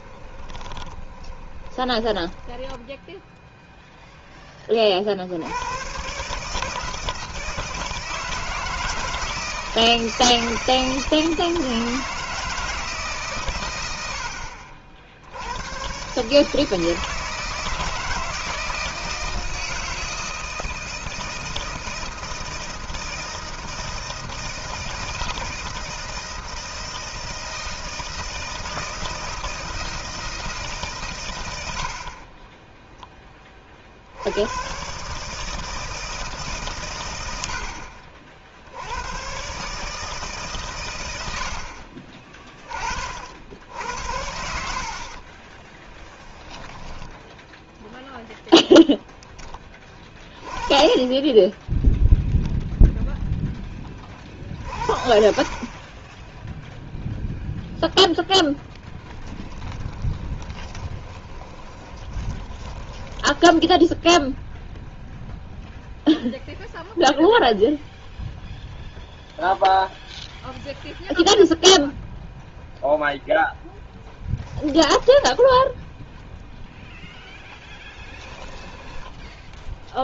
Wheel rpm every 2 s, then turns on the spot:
20, 10, 30, 150, 160, 160, 160, 70, 160, 160, 160, 160, 160, 160, 160, 150, 20, 120, 140, 80, 130, 40, 50, 10, 0, 20, 0, 50, 0, 0, 20, 20, 0, 0, 0, 0, 0, 10, 0, 10.
0-4 32-34 44-46 60-64 74-76 78-80